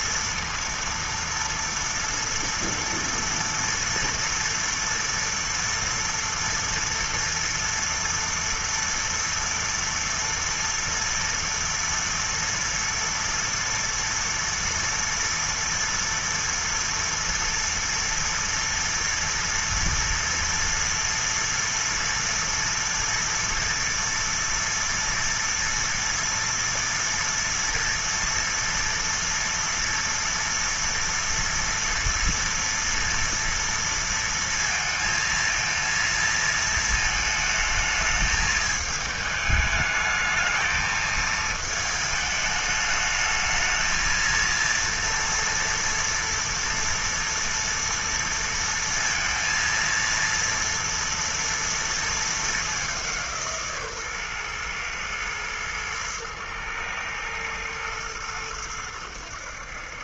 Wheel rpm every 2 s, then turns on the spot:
230, 230, 230, 230, 230, 230, 230, 230, 230, 230, 230, 230, 230, 230, 230, 230, 230, 230, 230, 210, 220, 210, 230, 230, 230, 230, 210, 120, 110, 100.
none